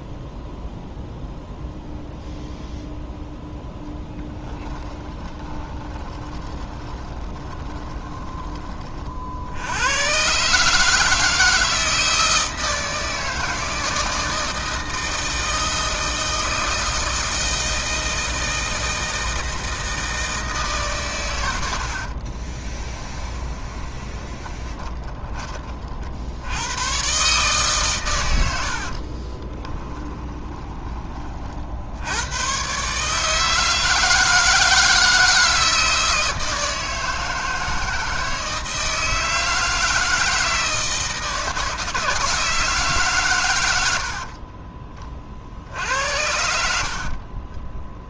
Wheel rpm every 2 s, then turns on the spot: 0, 0, 10, 20, 20, 150, 160, 160, 160, 160, 160, 20, 20, 100, 80, 20, 120, 160, 160, 160, 160, 160, 40, 70.
4-8 22-26 30-32 44-48